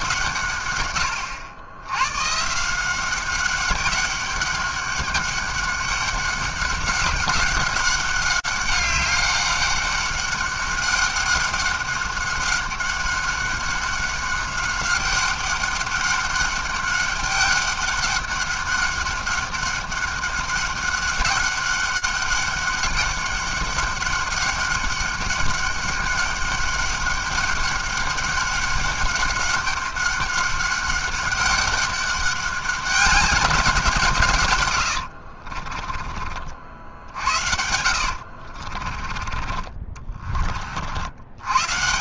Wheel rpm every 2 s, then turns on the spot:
140, 150, 200, 190, 190, 200, 190, 200, 200, 200, 190, 200, 200, 200, 200, 200, 200, 110, 50, 50, 40.
36-40